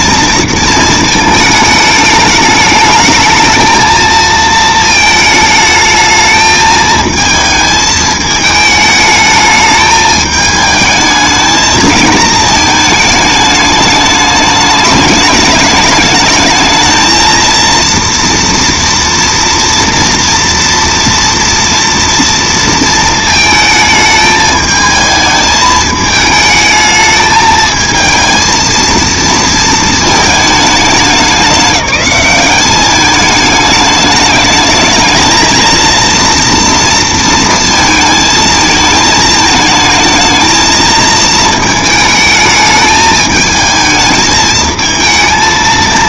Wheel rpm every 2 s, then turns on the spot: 230, 210, 220, 220, 220, 220, 220, 210, 220, 230, 230, 230, 220, 220, 230, 200, 200, 220, 230, 220, 220, 220, 220.
none